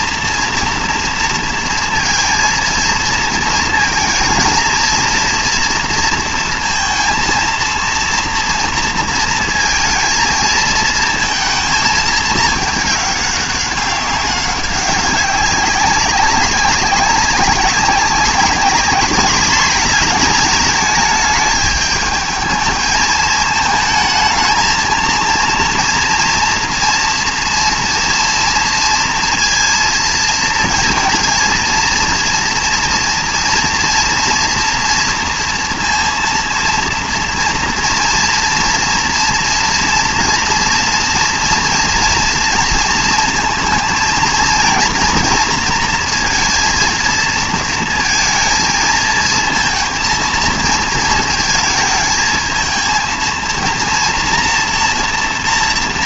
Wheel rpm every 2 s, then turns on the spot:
240, 230, 230, 230, 230, 220, 210, 190, 190, 200, 220, 220, 220, 230, 230, 230, 230, 240, 230, 230, 230, 230, 230, 230, 230, 220, 230, 230.
none